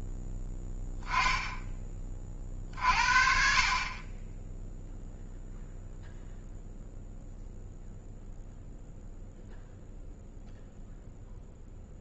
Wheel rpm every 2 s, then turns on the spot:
0, 40, 0, 0, 0, 0.
none